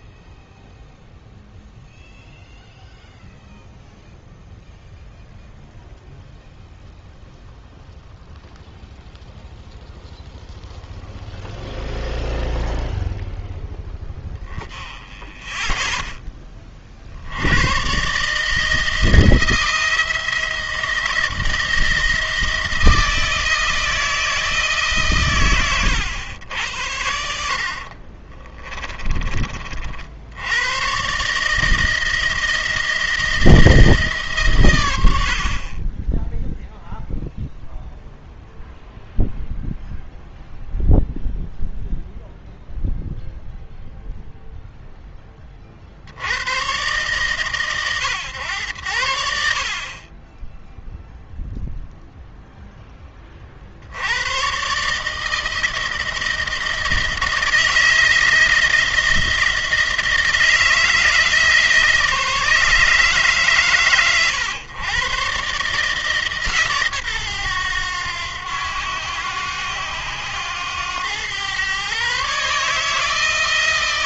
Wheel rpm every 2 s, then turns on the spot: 0, 0, 0, 0, 0, 0, 0, 10, 30, 150, 170, 160, 150, 80, 30, 90, 170, 120, 0, 0, 0, 0, 0, 110, 100, 10, 0, 120, 160, 170, 160, 160, 120, 140, 90, 100, 150.
28-30